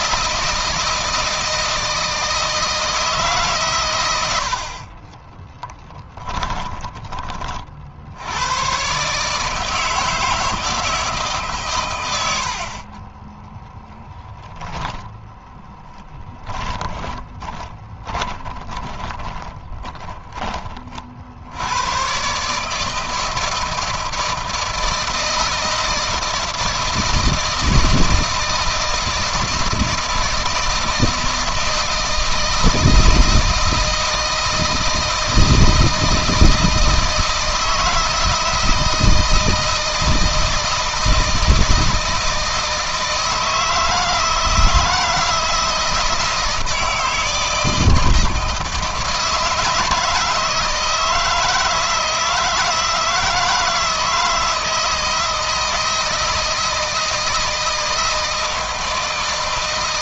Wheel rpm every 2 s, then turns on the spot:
170, 160, 40, 20, 130, 160, 30, 10, 20, 20, 40, 150, 160, 160, 160, 160, 160, 160, 160, 170, 160, 160, 170, 160, 160, 160, 160, 160, 160, 160.
4-6 14-20